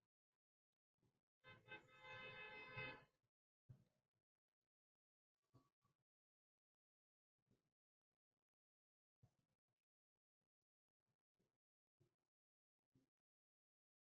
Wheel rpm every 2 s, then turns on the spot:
0, 0, 0, 0, 0, 0, 0.
none